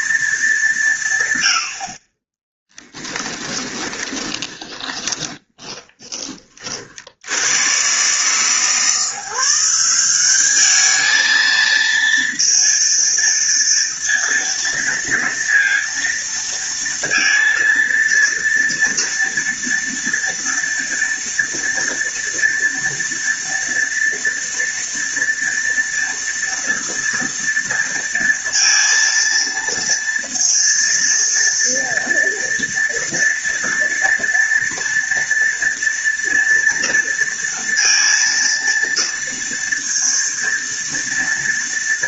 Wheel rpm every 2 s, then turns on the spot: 200, 10, 20, 40, 150, 210, 230, 230, 230, 230, 230, 230, 230, 230, 230, 230, 230, 230, 230, 230, 230.
2-6